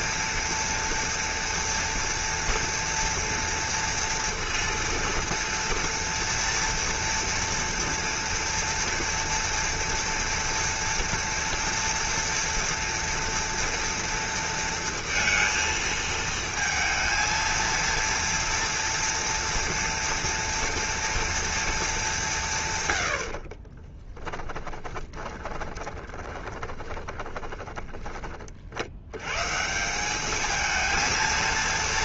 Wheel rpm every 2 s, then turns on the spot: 230, 230, 230, 230, 230, 230, 230, 230, 230, 230, 230, 130, 20, 20, 70, 220.
24-28